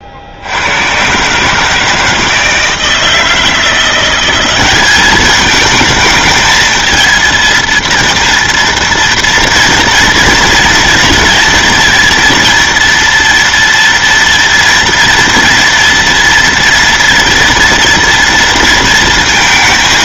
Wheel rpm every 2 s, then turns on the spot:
90, 160, 190, 220, 230, 230, 230, 230, 230, 230.
none